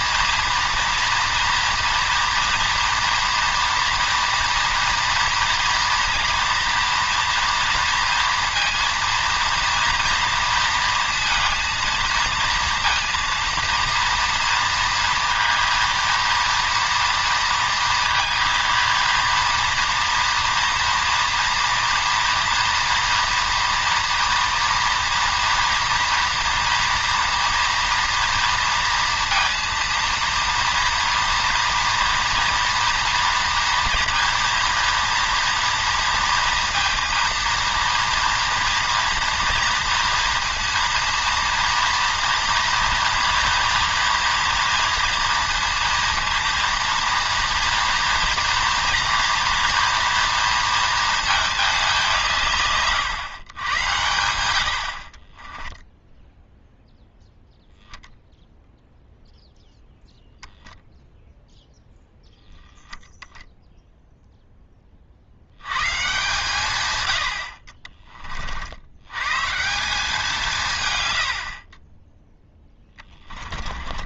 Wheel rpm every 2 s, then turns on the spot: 230, 230, 230, 230, 230, 230, 230, 230, 230, 230, 230, 230, 240, 240, 230, 230, 230, 230, 230, 230, 230, 240, 240, 230, 230, 230, 150, 70, 0, 0, 0, 0, 10, 130, 60, 160, 10.
72-74